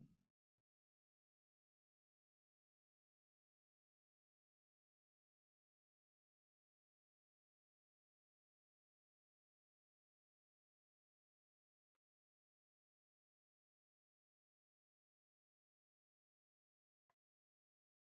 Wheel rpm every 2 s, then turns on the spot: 0, 0, 0, 0, 0, 0, 0, 0, 0.
none